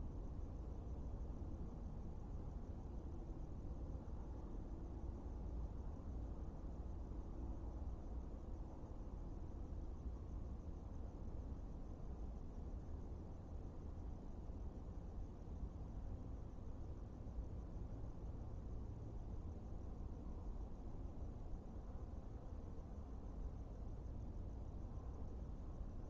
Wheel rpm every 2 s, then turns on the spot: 0, 0, 0, 0, 0, 0, 0, 0, 0, 0, 0, 0, 0.
none